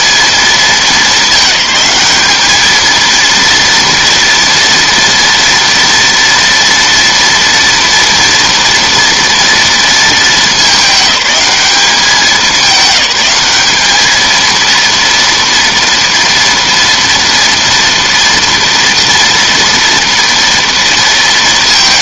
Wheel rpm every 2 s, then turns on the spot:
210, 230, 230, 230, 230, 210, 190, 230, 230, 230, 230.
none